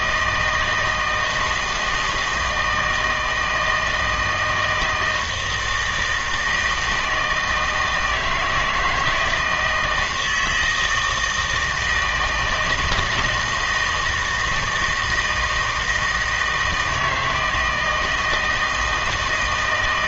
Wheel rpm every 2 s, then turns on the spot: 160, 160, 160, 160, 170, 160, 160, 160, 160, 160.
none